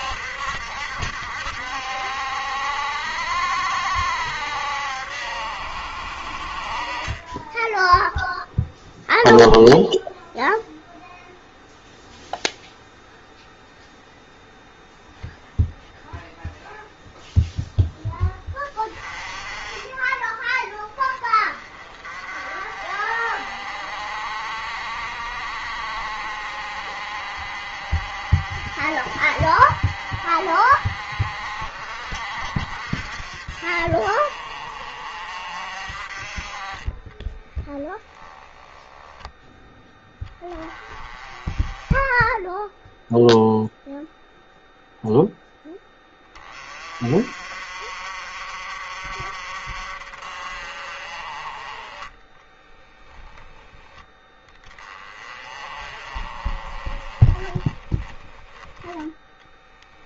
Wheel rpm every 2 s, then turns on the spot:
70, 70, 70, 50, 0, 0, 0, 0, 0, 10, 20, 40, 50, 50, 50, 50, 50, 50, 30, 10, 20, 10, 0, 20, 50, 50, 10, 10, 40, 10.
52-54